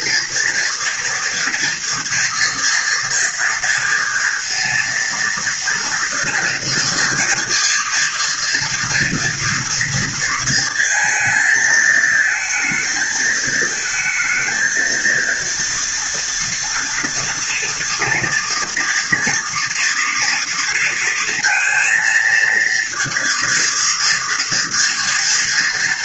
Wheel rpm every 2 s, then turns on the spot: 230, 230, 230, 240, 230, 230, 220, 230, 230, 230, 230, 230, 230.
none